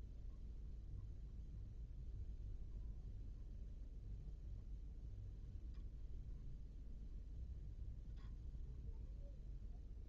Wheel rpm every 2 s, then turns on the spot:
0, 0, 0, 0, 0.
none